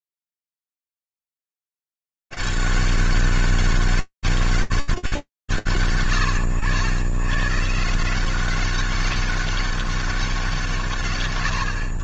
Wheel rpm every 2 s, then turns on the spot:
90, 200, 200, 110, 170, 200.
none